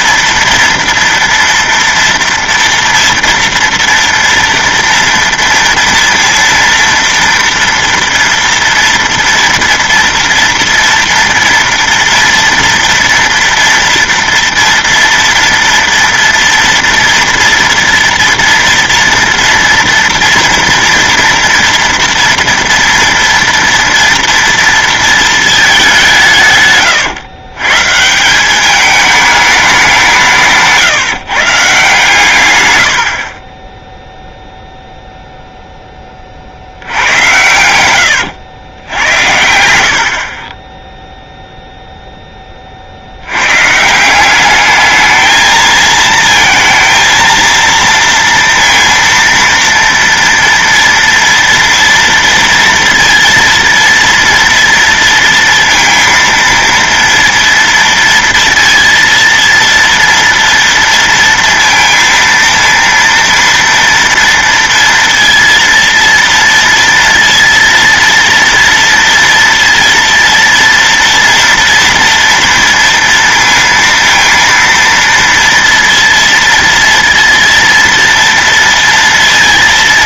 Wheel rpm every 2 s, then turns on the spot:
240, 230, 230, 230, 230, 230, 230, 230, 230, 230, 230, 240, 230, 140, 200, 160, 120, 0, 60, 100, 20, 30, 210, 230, 230, 230, 230, 230, 230, 230, 230, 230, 230, 230, 230, 230, 230, 230, 230, 230.
none